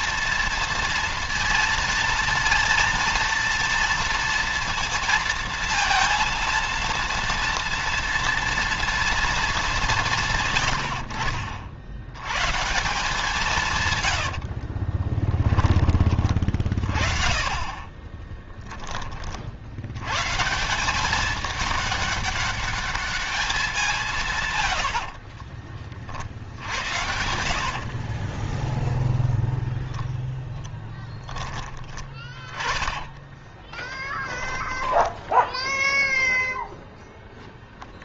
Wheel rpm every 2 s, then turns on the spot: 230, 230, 230, 230, 240, 80, 160, 30, 30, 20, 190, 200, 80, 70, 0, 10, 10, 0, 0.
14-16 24-26 30-34